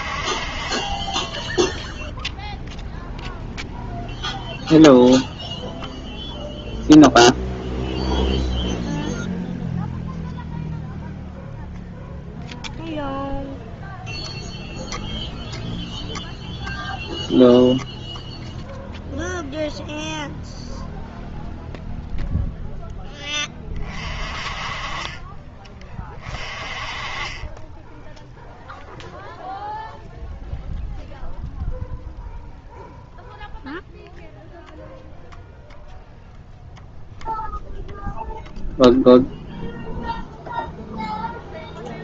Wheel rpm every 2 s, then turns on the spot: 30, 0, 0, 0, 0, 0, 0, 0, 0, 0, 0, 0, 30, 30, 0, 0, 0, 0, 0, 0, 0.
none